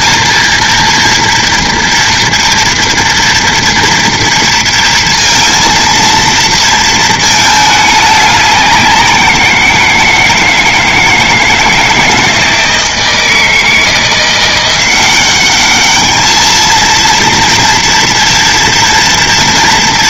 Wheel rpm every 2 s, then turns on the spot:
230, 230, 230, 230, 190, 170, 160, 180, 220, 230.
none